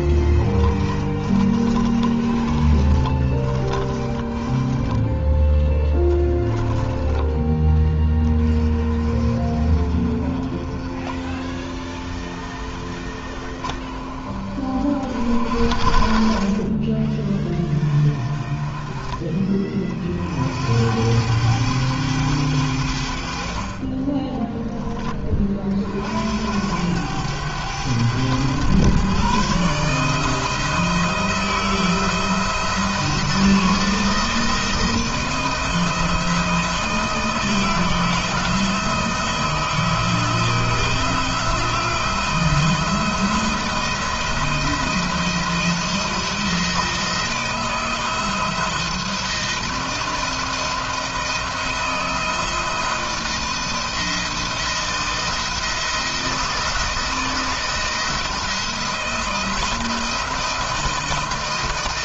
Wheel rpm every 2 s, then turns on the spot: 20, 30, 10, 10, 30, 40, 40, 50, 20, 30, 80, 80, 20, 90, 120, 160, 160, 170, 160, 160, 160, 170, 170, 170, 170, 170, 160, 170, 160, 160, 160.
0-6